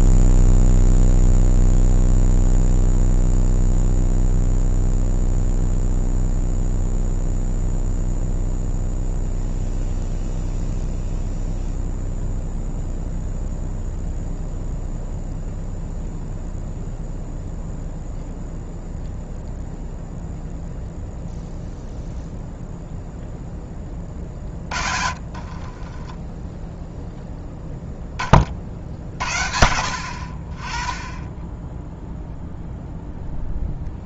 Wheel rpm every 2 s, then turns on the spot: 0, 0, 0, 0, 0, 0, 0, 0, 0, 0, 0, 0, 30, 0, 40, 30, 0.
24-26